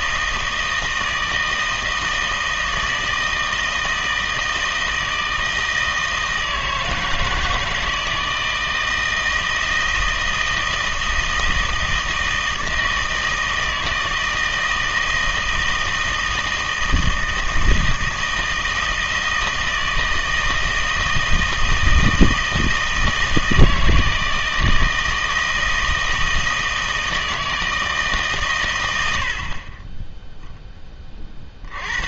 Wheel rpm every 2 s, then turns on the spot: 160, 160, 160, 160, 160, 160, 160, 160, 160, 160, 160, 160, 160, 160, 120, 10.
none